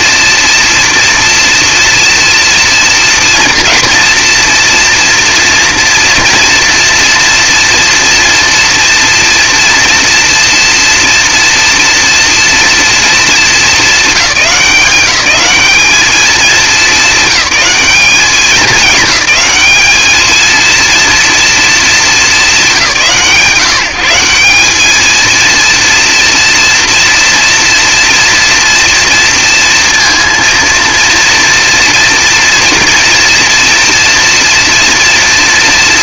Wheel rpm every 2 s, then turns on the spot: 240, 230, 230, 230, 230, 230, 220, 190, 220, 200, 230, 180, 200, 230, 230, 230, 230, 240.
none